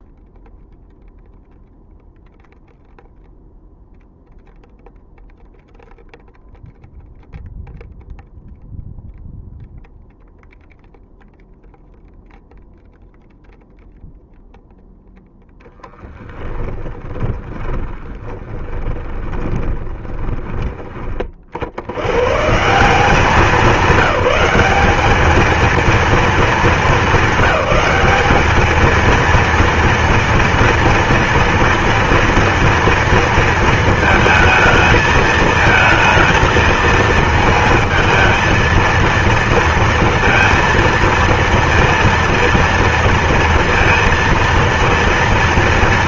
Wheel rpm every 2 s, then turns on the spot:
0, 0, 0, 0, 0, 0, 0, 0, 20, 20, 30, 170, 200, 220, 220, 230, 230, 220, 230, 230, 230, 230, 220.
16-22